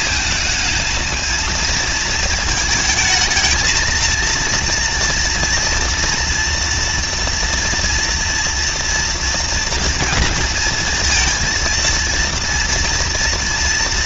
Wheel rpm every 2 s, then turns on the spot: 210, 230, 230, 230, 230, 230, 230.
none